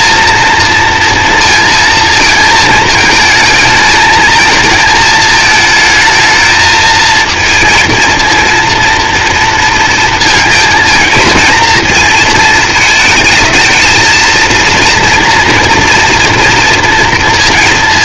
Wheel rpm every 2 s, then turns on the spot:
230, 220, 230, 220, 230, 230, 220, 230, 230.
none